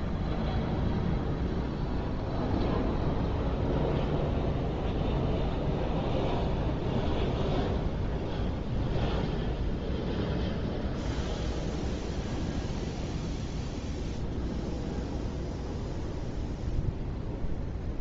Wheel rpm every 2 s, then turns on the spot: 0, 0, 0, 0, 0, 0, 0, 0, 0.
none